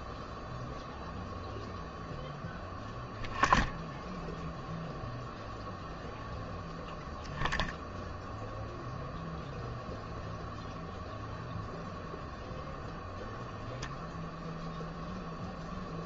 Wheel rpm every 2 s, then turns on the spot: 0, 0, 0, 10, 0, 0, 0, 0.
none